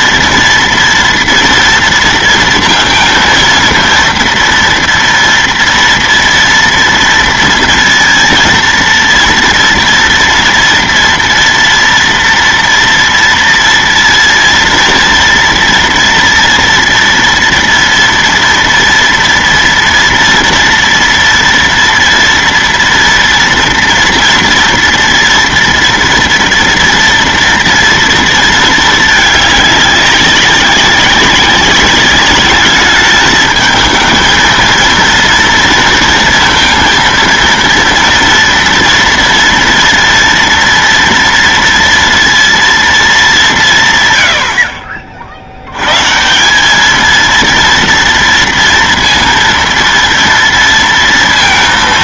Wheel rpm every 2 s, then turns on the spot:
230, 230, 230, 230, 230, 230, 230, 230, 230, 240, 240, 230, 230, 230, 220, 190, 210, 230, 230, 230, 230, 230, 60, 210, 230, 230.
none